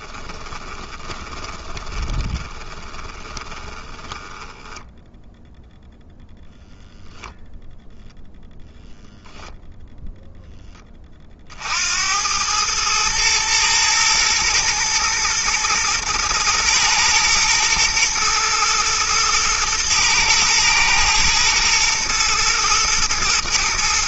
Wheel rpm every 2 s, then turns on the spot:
20, 20, 0, 0, 0, 10, 110, 110, 110, 110, 120, 110.
0-4